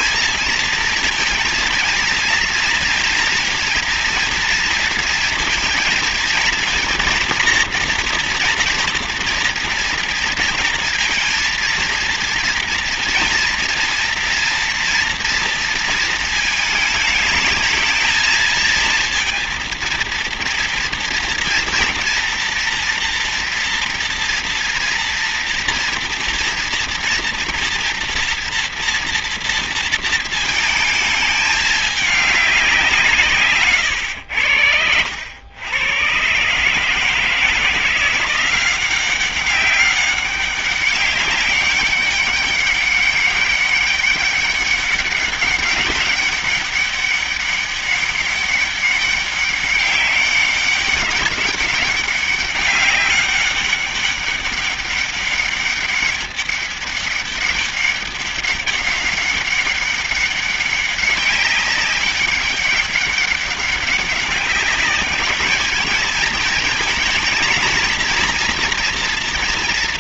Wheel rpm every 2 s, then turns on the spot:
230, 230, 230, 230, 240, 230, 230, 230, 230, 230, 230, 230, 230, 230, 230, 220, 200, 90, 130, 180, 200, 200, 200, 200, 200, 200, 200, 190, 200, 200, 200, 200, 190, 220, 230.
none